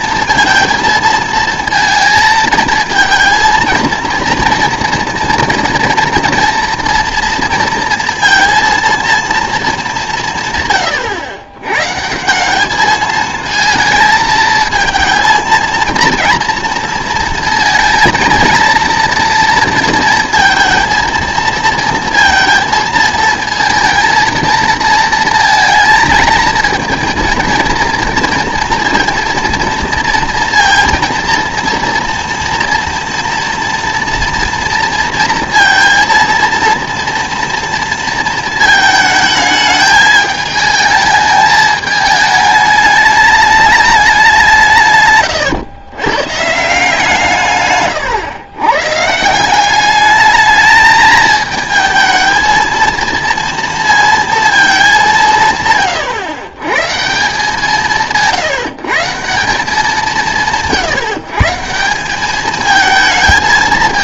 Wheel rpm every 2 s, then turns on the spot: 230, 220, 230, 230, 230, 120, 200, 220, 230, 230, 230, 230, 230, 230, 230, 230, 230, 230, 230, 220, 220, 210, 170, 150, 120, 210, 230, 220, 120, 170, 160, 220.
none